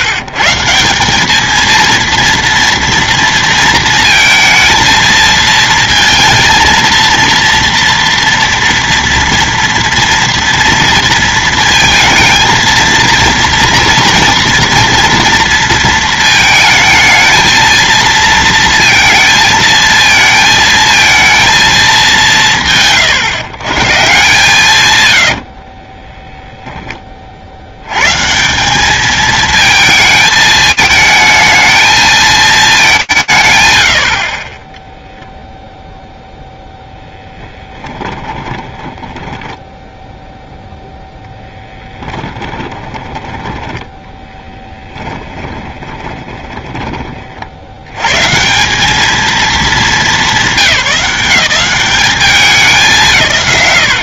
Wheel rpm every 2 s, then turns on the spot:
130, 230, 230, 230, 230, 230, 230, 230, 220, 230, 220, 130, 150, 10, 190, 220, 190, 0, 10, 10, 0, 10, 10, 30, 210, 190, 170.
36-40 42-46